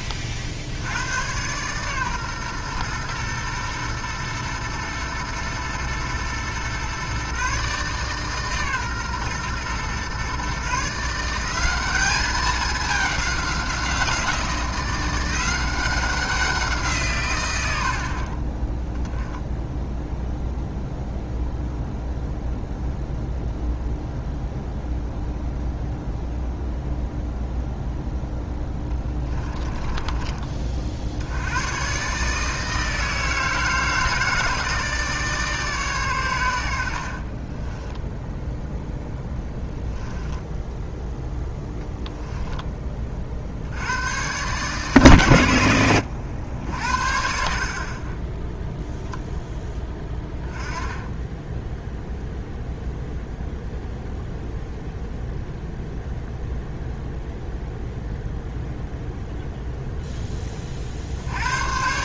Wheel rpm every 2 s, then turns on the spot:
60, 120, 120, 120, 140, 140, 200, 170, 170, 20, 0, 0, 0, 0, 10, 30, 160, 160, 80, 0, 10, 10, 130, 70, 10, 10, 0, 0, 0, 0, 30.
28-30